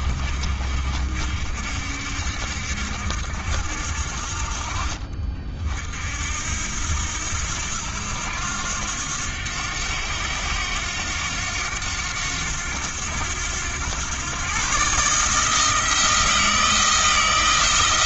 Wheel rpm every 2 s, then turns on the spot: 50, 70, 40, 80, 90, 90, 90, 130, 160.
none